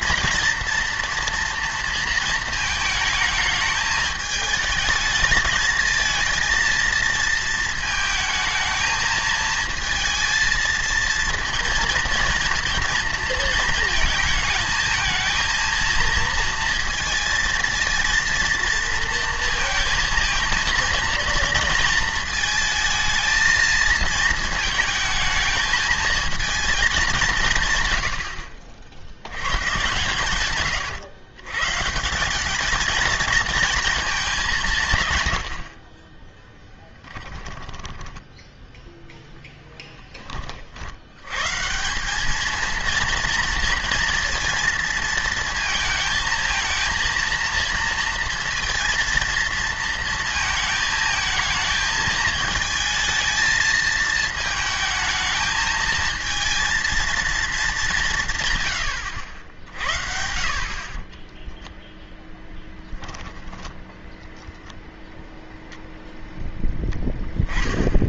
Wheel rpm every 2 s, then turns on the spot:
230, 220, 220, 230, 220, 220, 230, 220, 230, 230, 230, 220, 220, 220, 60, 120, 210, 180, 10, 10, 50, 220, 230, 230, 230, 220, 220, 220, 230, 140, 50, 10, 0, 10.
36-38